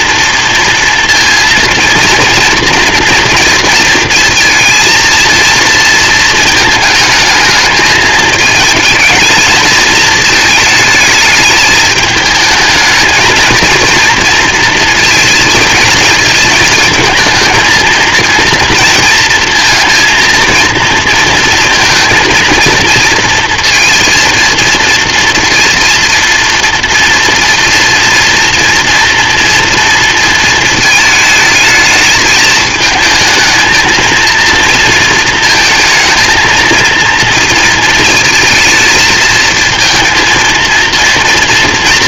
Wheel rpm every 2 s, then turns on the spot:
240, 230, 220, 220, 230, 220, 220, 230, 220, 230, 230, 230, 230, 230, 230, 220, 220, 230, 230, 220, 230.
none